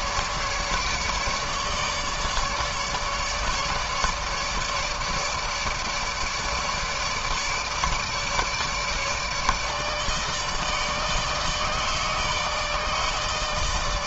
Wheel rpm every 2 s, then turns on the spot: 150, 150, 150, 150, 150, 150, 160.
none